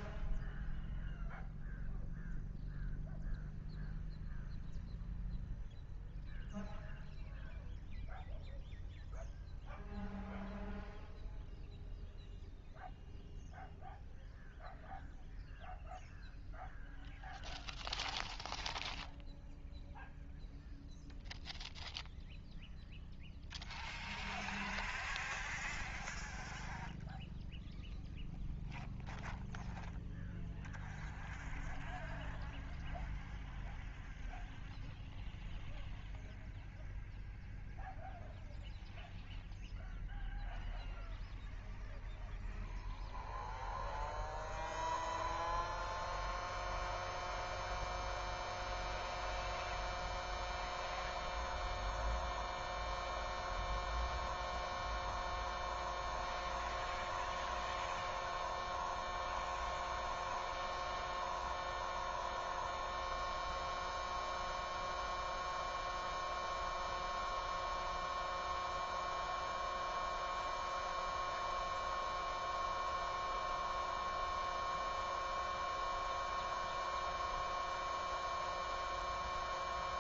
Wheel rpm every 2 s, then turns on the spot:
0, 0, 0, 0, 0, 0, 0, 0, 0, 0, 0, 0, 0, 0, 0, 0, 0, 0, 0, 0, 0, 0, 0, 0, 0, 0, 0, 0, 0, 0, 0, 0, 0, 0, 0, 0, 0, 0, 0, 0.
none